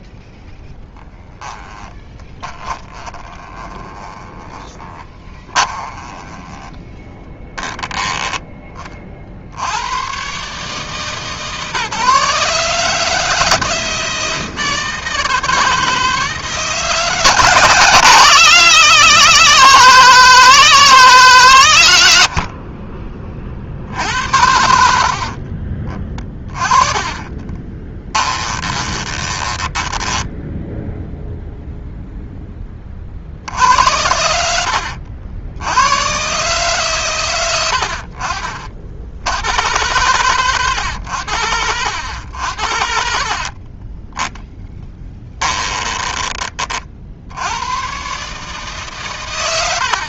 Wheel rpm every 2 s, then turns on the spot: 10, 30, 20, 10, 20, 140, 150, 160, 150, 150, 160, 40, 70, 30, 20, 0, 30, 80, 130, 60, 110, 70, 10, 30, 150.
2-6 24-30